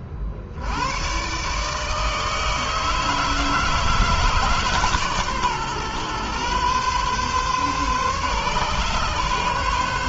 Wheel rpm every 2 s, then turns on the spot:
100, 150, 140, 130, 140.
none